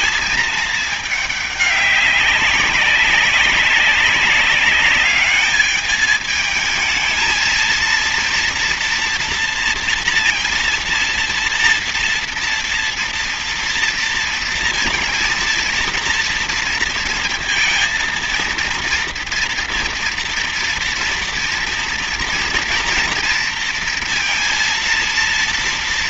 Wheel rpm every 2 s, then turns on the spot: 220, 200, 200, 220, 230, 230, 230, 230, 230, 230, 230, 230, 230.
none